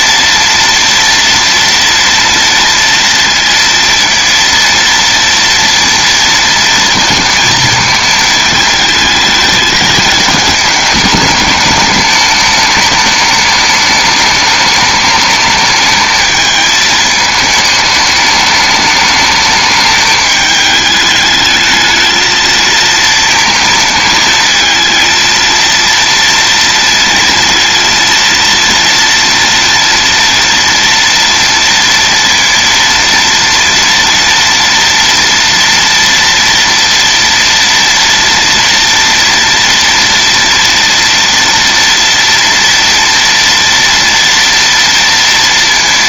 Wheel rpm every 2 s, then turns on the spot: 240, 230, 230, 230, 220, 210, 210, 210, 220, 210, 210, 220, 230, 230, 230, 230, 230, 230, 230, 230, 240, 230, 230.
none